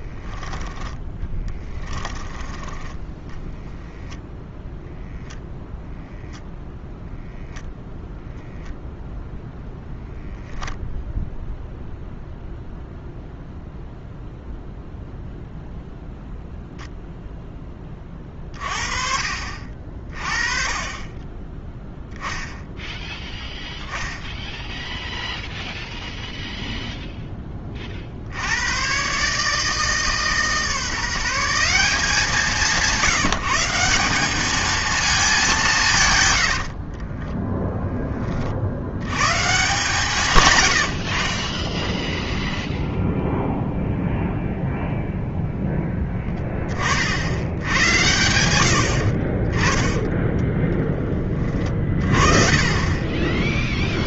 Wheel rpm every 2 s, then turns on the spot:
10, 10, 0, 0, 0, 0, 0, 0, 0, 40, 20, 0, 0, 0, 120, 160, 170, 220, 30, 90, 70, 0, 0, 60, 50, 10, 20.
36-38 40-42 52-54